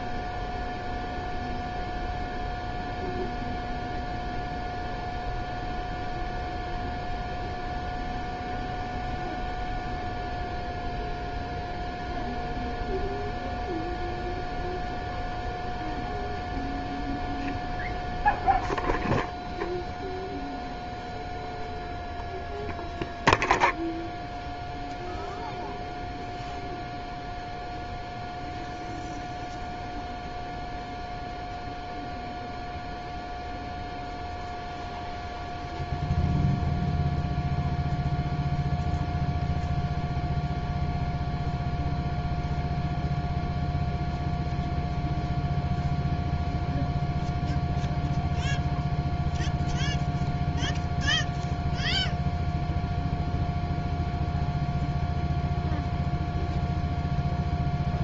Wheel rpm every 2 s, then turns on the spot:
0, 0, 0, 0, 0, 0, 0, 0, 0, 0, 0, 0, 0, 0, 0, 0, 0, 0, 0, 0, 0, 0, 0, 0, 0, 0, 0, 0, 0.
none